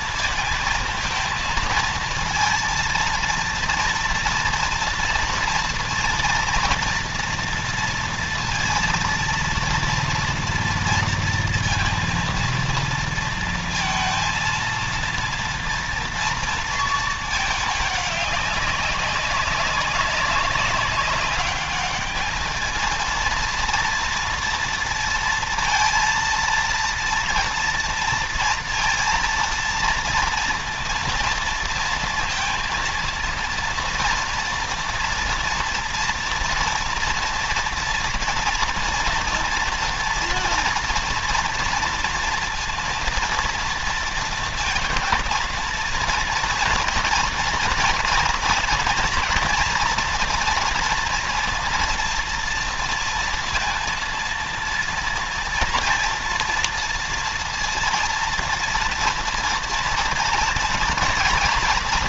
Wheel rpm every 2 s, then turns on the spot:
230, 230, 230, 230, 230, 240, 230, 230, 230, 200, 190, 210, 230, 230, 230, 230, 230, 230, 230, 230, 240, 230, 230, 230, 230, 240, 230, 230, 230, 230, 230.
none